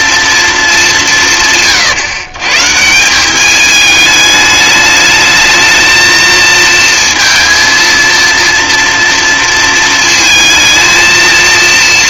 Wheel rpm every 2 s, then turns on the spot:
210, 160, 210, 230, 230, 220.
none